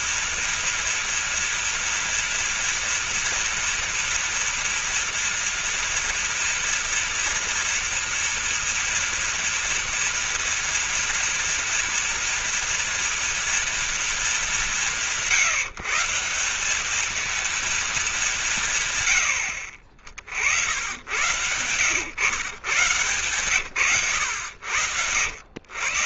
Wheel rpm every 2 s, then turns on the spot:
230, 230, 240, 230, 230, 230, 230, 200, 200, 150, 70, 120, 90.
none